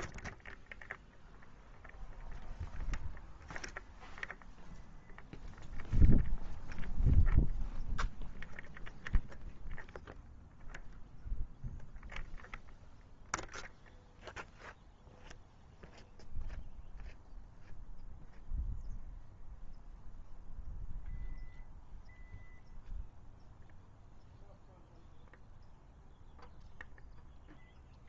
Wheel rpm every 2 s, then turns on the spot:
0, 0, 0, 0, 0, 0, 0, 0, 0, 0, 0, 0, 0, 0.
none